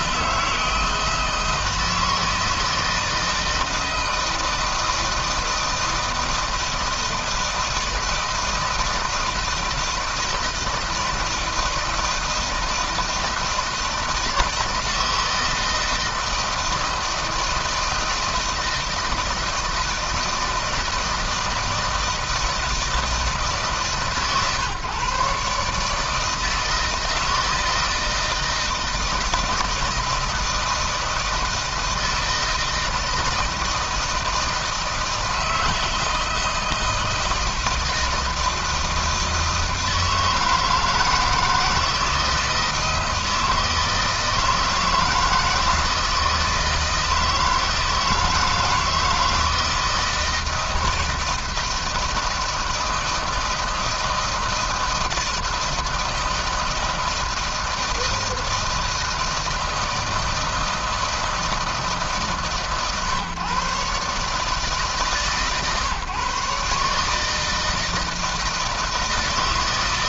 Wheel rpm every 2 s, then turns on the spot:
160, 160, 160, 160, 160, 160, 160, 160, 160, 160, 160, 160, 140, 160, 160, 160, 160, 160, 160, 160, 160, 160, 170, 160, 160, 160, 160, 160, 160, 160, 160, 140, 150, 150, 160.
none